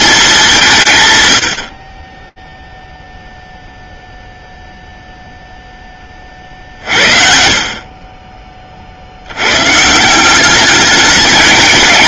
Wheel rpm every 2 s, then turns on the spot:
120, 0, 0, 60, 100, 210.
none